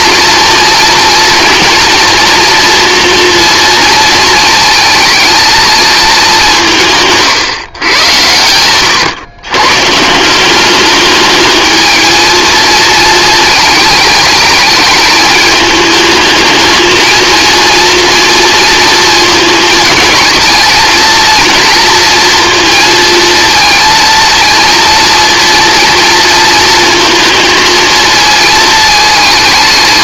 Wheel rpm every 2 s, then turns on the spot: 240, 230, 220, 170, 110, 200, 230, 220, 220, 230, 230, 230, 230, 230, 220.
8-10